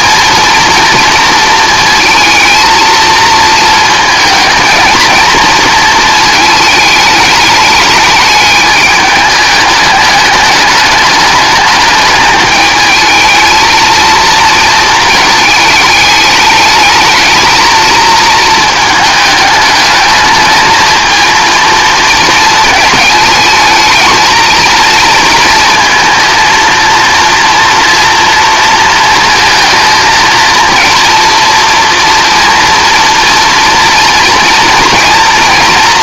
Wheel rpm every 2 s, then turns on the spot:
230, 230, 220, 210, 210, 210, 220, 220, 210, 220, 220, 220, 230, 230, 230, 230, 240, 230.
none